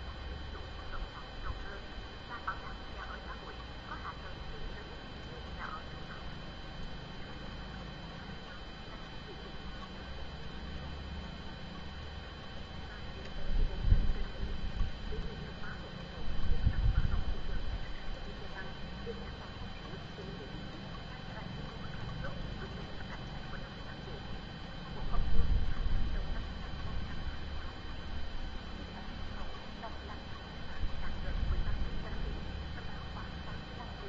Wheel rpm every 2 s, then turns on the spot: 0, 0, 0, 0, 0, 0, 0, 0, 0, 0, 0, 0, 0, 0, 0, 0, 0.
none